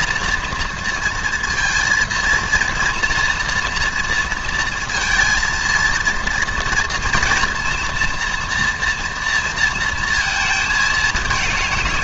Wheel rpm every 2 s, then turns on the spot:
230, 230, 230, 230, 230, 220.
none